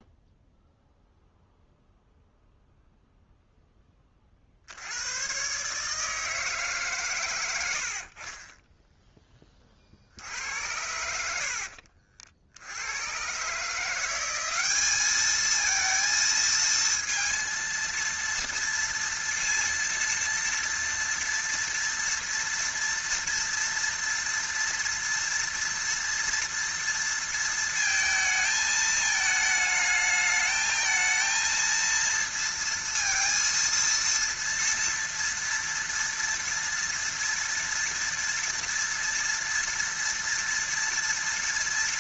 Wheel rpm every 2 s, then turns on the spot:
0, 0, 60, 150, 20, 70, 60, 200, 230, 230, 230, 230, 230, 230, 220, 220, 230, 230, 230, 230, 230.
none